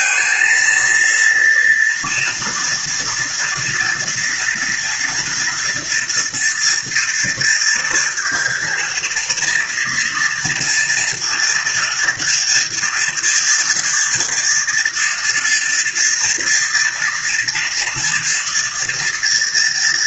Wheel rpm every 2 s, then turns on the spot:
230, 230, 240, 230, 230, 230, 240, 230, 230, 230.
none